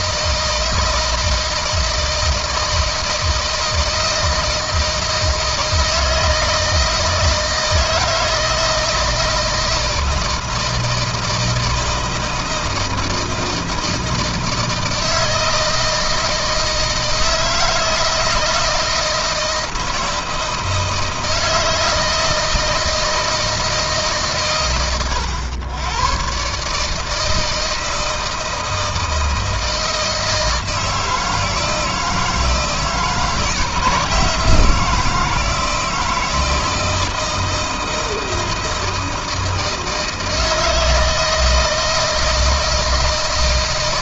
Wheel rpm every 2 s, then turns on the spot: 160, 160, 170, 160, 160, 160, 160, 160, 160, 160, 160, 160, 120, 130, 160, 160, 160, 170, 160, 160, 160, 160.
none